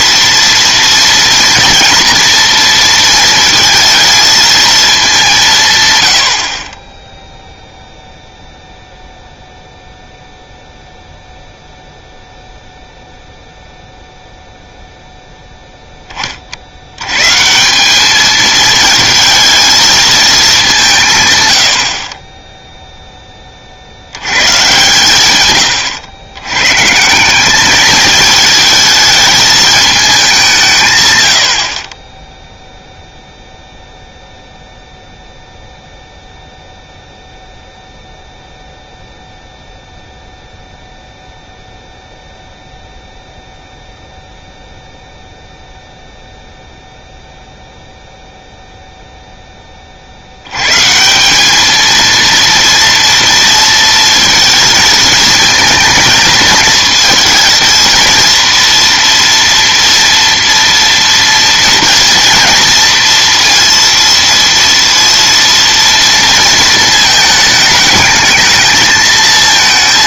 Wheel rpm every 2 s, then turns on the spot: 230, 230, 220, 40, 0, 0, 0, 0, 50, 220, 200, 10, 130, 130, 220, 160, 0, 0, 0, 0, 0, 0, 0, 0, 0, 110, 230, 220, 220, 240, 230, 230, 230, 230, 220.
none